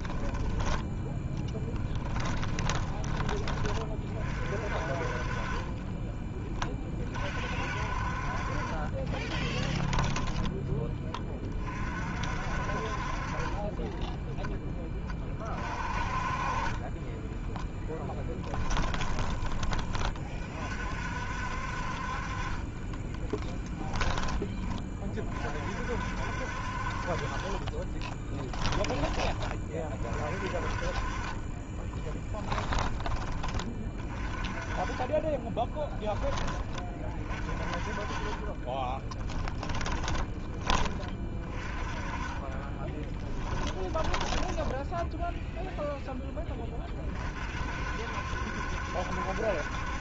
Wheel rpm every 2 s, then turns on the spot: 10, 10, 40, 30, 40, 10, 50, 10, 30, 10, 40, 30, 20, 60, 10, 40, 20, 30, 20, 20, 20, 20, 10, 20, 70.
2-4 18-20 28-30 32-34 38-40 42-46